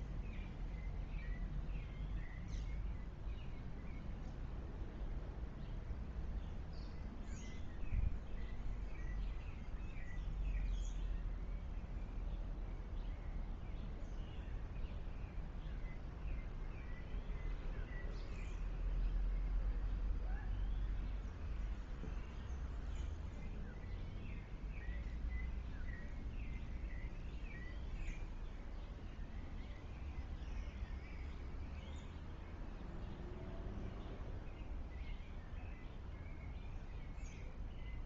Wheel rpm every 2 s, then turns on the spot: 0, 0, 0, 0, 0, 0, 0, 0, 0, 0, 0, 0, 0, 0, 0, 0, 0, 0, 0.
none